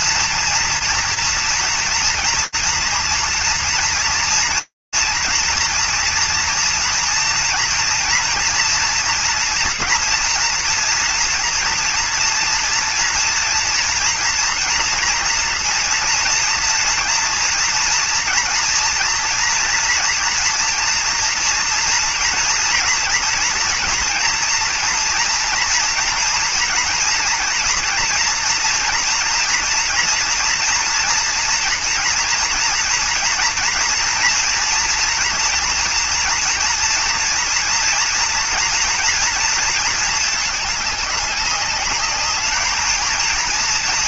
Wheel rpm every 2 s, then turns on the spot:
240, 240, 230, 230, 230, 230, 240, 230, 230, 230, 240, 230, 230, 230, 230, 230, 240, 230, 230, 230, 220, 220.
none